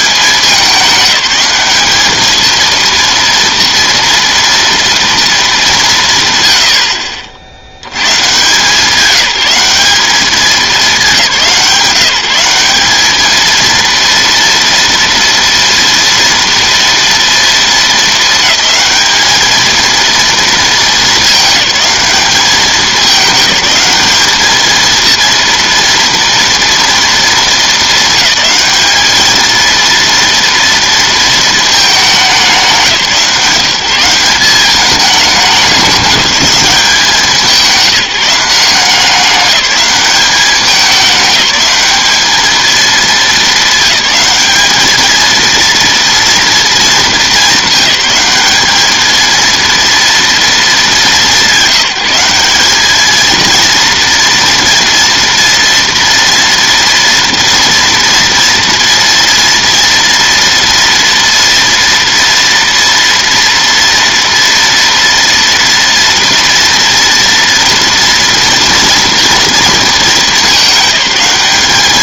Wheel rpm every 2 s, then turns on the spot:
200, 230, 230, 80, 160, 200, 200, 230, 230, 210, 220, 200, 220, 230, 210, 230, 180, 190, 190, 180, 200, 220, 220, 220, 210, 220, 200, 230, 230, 230, 230, 230, 230, 230, 230, 200.
none